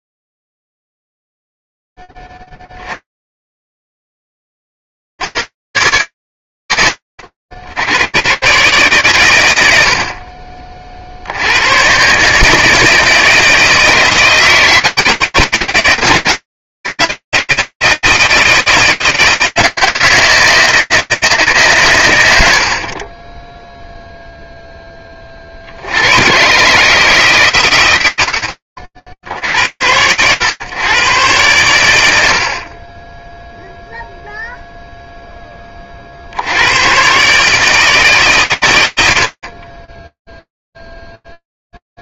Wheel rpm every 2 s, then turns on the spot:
0, 50, 20, 80, 130, 40, 150, 160, 160, 160, 160, 60, 20, 150, 70, 110, 20, 10, 150, 60, 0.
none